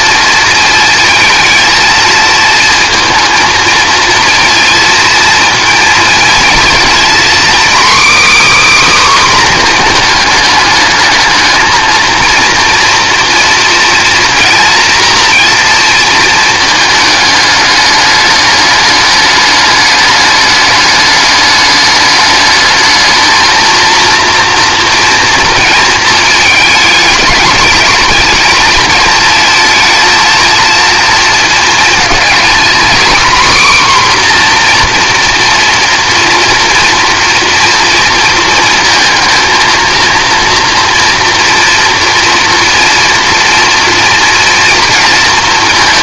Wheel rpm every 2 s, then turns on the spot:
220, 230, 230, 240, 290, 220, 230, 230, 220, 210, 210, 210, 230, 220, 220, 230, 240, 250, 230, 220, 230, 230, 230.
none